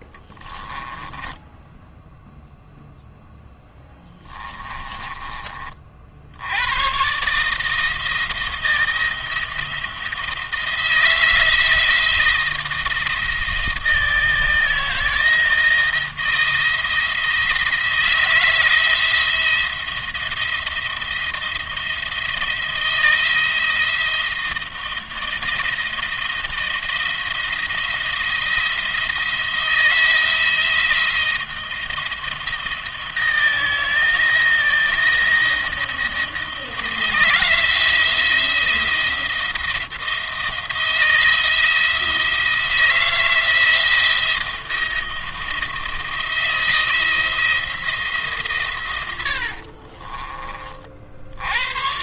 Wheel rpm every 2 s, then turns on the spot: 10, 0, 20, 120, 170, 160, 160, 160, 170, 170, 170, 170, 170, 170, 170, 160, 160, 160, 160, 170, 170, 170, 170, 170, 110, 60.
0-2 4-6 48-50